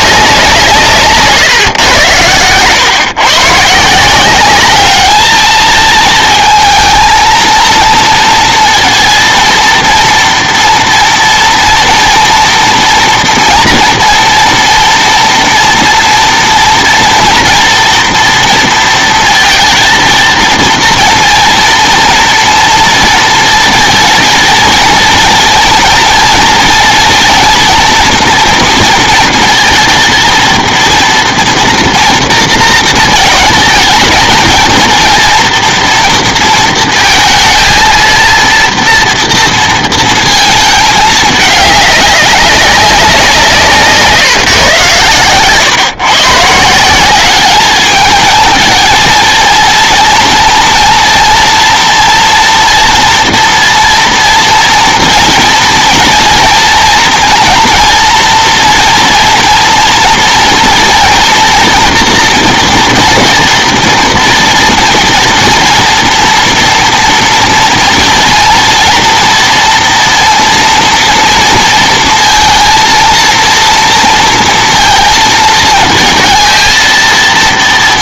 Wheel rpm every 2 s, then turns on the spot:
170, 120, 200, 230, 230, 230, 230, 230, 240, 230, 230, 230, 230, 230, 230, 230, 220, 230, 230, 230, 220, 200, 130, 150, 220, 230, 230, 230, 230, 230, 230, 230, 230, 230, 230, 230, 230, 230, 230.
none